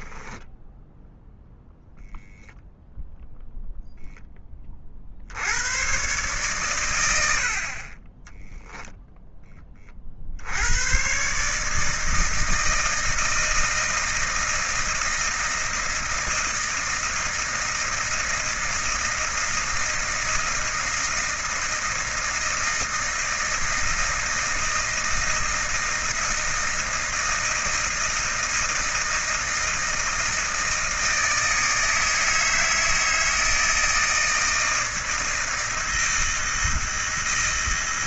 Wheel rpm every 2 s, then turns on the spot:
0, 0, 30, 120, 0, 90, 160, 160, 160, 160, 160, 160, 160, 160, 170, 160, 160, 160, 160.
none